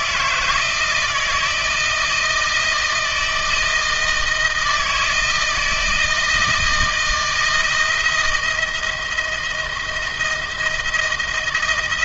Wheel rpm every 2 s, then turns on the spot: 160, 170, 160, 160, 170, 160.
none